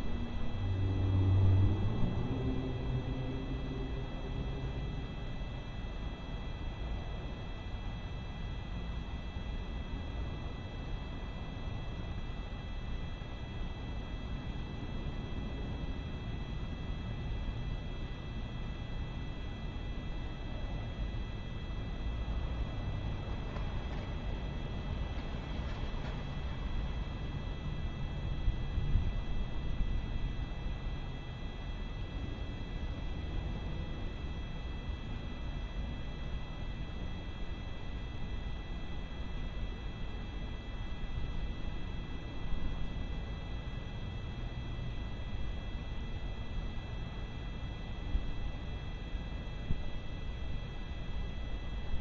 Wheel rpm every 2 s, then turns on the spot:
0, 0, 0, 0, 0, 0, 0, 0, 0, 0, 0, 0, 0, 0, 0, 0, 0, 0, 0, 0, 0, 0, 0, 0, 0, 0.
none